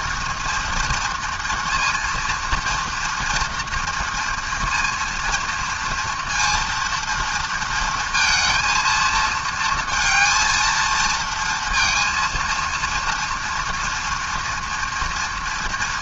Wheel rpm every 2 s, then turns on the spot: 240, 230, 230, 230, 230, 220, 230, 230.
none